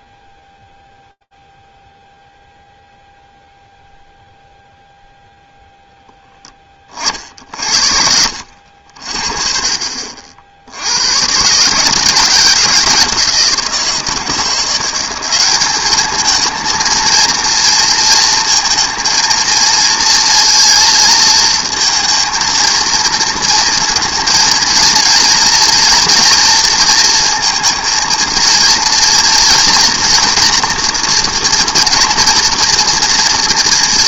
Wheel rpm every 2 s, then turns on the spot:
0, 0, 0, 40, 60, 100, 160, 190, 230, 230, 230, 230, 230, 230, 230, 240, 230.
none